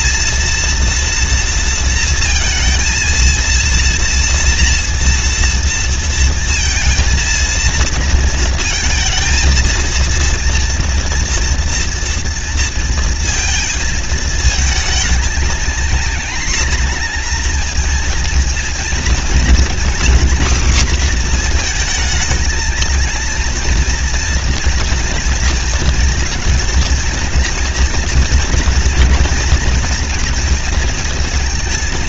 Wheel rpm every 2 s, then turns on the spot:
230, 230, 240, 230, 230, 230, 230, 230, 230, 230, 250, 220, 230, 230, 240, 230.
none